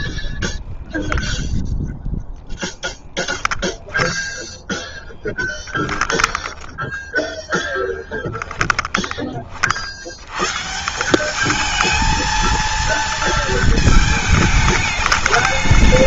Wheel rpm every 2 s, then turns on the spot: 20, 10, 10, 10, 10, 170, 230, 210.
0-6